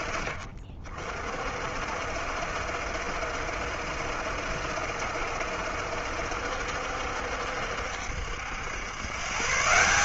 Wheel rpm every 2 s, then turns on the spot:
40, 70, 70, 70, 120.
none